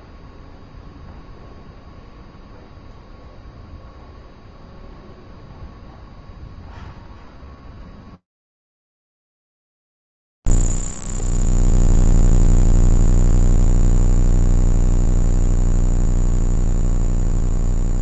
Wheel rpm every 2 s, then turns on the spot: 0, 0, 0, 0, 0, 0, 0, 0, 0.
none